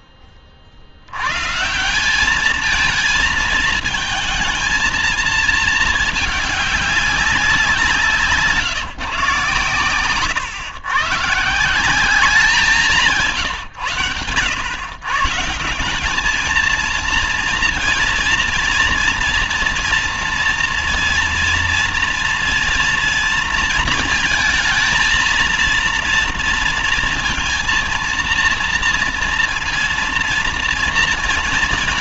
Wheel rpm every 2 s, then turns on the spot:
40, 210, 220, 200, 160, 120, 180, 110, 220, 230, 230, 230, 220, 230, 230, 230.
none